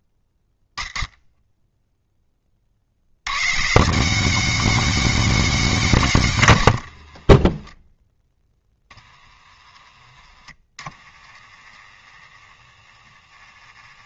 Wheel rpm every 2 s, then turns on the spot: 0, 90, 200, 120, 20, 20, 20.
6-14